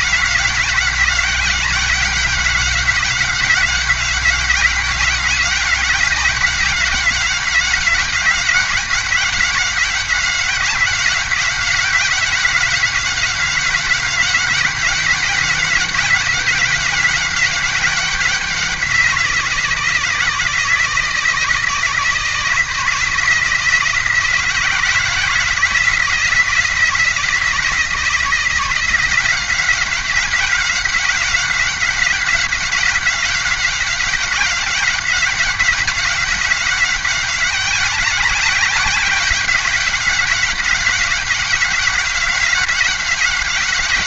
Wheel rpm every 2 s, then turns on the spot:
190, 190, 190, 190, 190, 190, 190, 190, 190, 190, 160, 160, 170, 170, 170, 180, 190, 190, 190, 190, 190, 190.
none